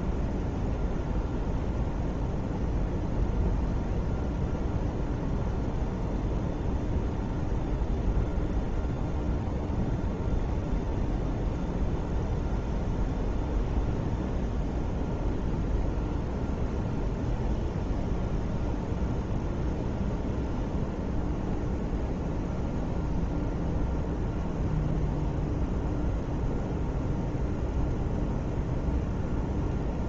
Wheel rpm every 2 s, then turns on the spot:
0, 0, 0, 0, 0, 0, 0, 0, 0, 0, 0, 0, 0, 0, 0.
none